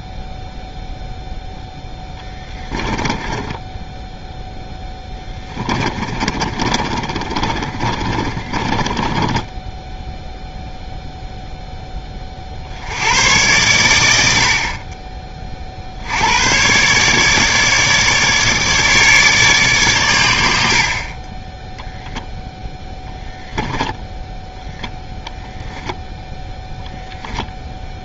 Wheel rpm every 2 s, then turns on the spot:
0, 10, 0, 30, 20, 0, 50, 60, 110, 150, 70, 0, 0, 0.
2-4 6-10